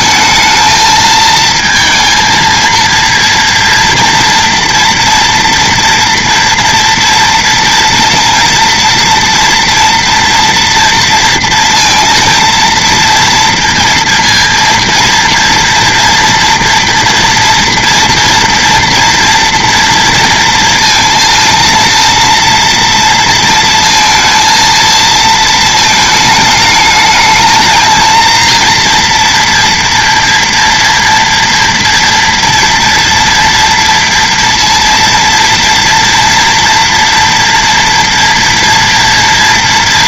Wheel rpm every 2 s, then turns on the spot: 220, 230, 230, 230, 230, 230, 230, 230, 240, 230, 230, 230, 230, 220, 230, 230, 230, 230, 240, 230.
none